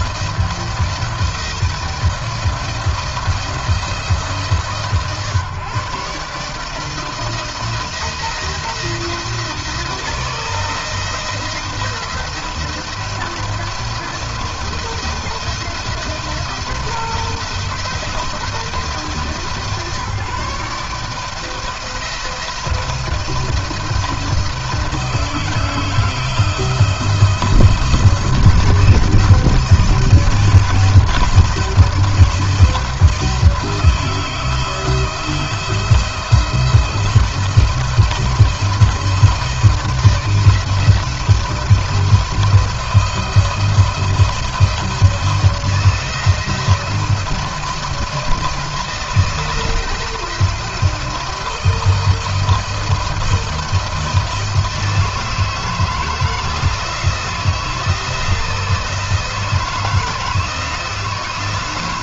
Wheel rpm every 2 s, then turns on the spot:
170, 170, 140, 160, 170, 170, 170, 170, 170, 160, 160, 170, 160, 170, 160, 160, 160, 160, 170, 170, 170, 170, 170, 170, 160, 170, 170, 160, 160, 160, 170.
none